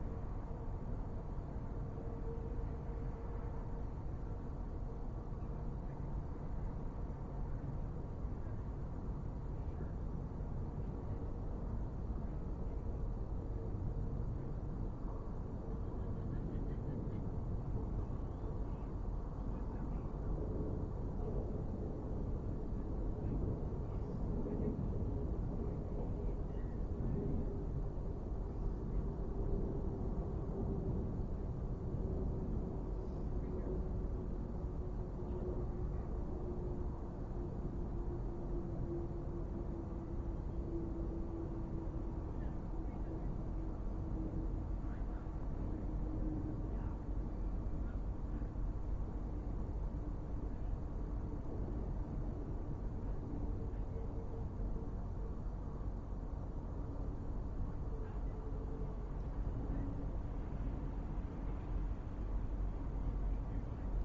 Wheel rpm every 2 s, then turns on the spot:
0, 0, 0, 0, 0, 0, 0, 0, 0, 0, 0, 0, 0, 0, 0, 0, 0, 0, 0, 0, 0, 0, 0, 0, 0, 0, 0, 0, 0, 0, 0, 0.
none